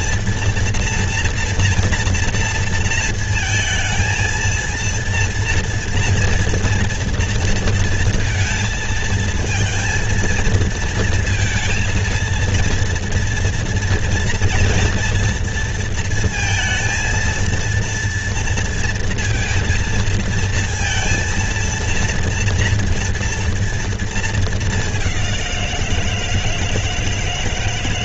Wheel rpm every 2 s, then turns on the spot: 240, 230, 230, 230, 230, 230, 230, 230, 220, 230, 230, 230, 210, 160.
none